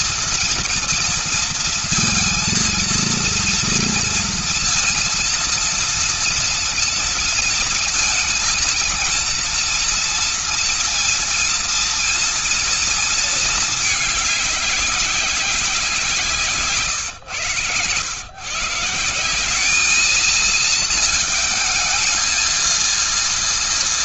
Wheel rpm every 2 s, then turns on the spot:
230, 230, 230, 230, 230, 230, 230, 200, 140, 160, 220, 230.
none